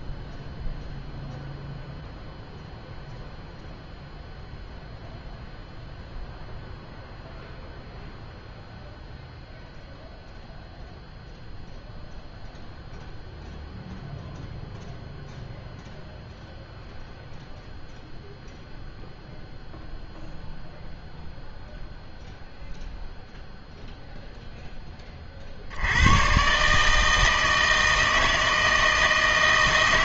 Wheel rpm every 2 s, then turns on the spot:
0, 0, 0, 0, 0, 0, 0, 0, 0, 0, 0, 0, 10, 140, 160.
none